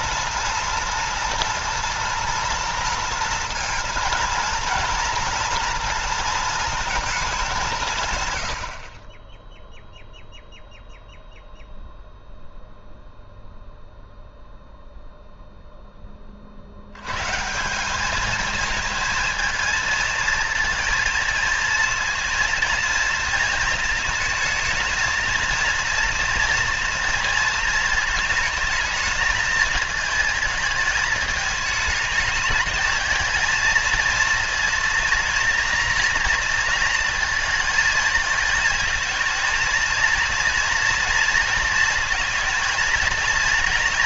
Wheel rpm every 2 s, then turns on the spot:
230, 230, 230, 230, 80, 0, 0, 0, 70, 220, 230, 230, 230, 230, 220, 220, 220, 230, 230, 220, 230, 220.
none